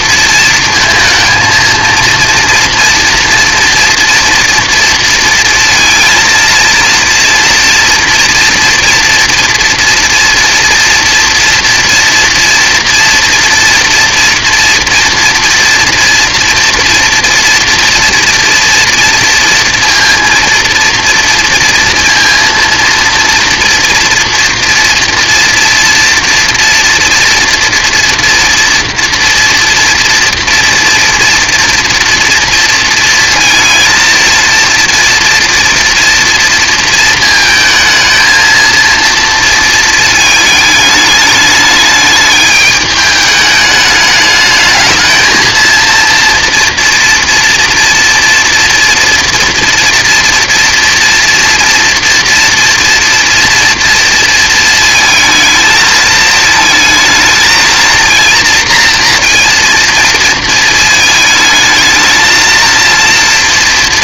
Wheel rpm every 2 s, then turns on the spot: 230, 230, 230, 230, 240, 230, 230, 230, 230, 230, 230, 230, 230, 230, 230, 240, 230, 240, 230, 230, 220, 210, 220, 230, 230, 230, 230, 230, 220, 230, 220, 230.
none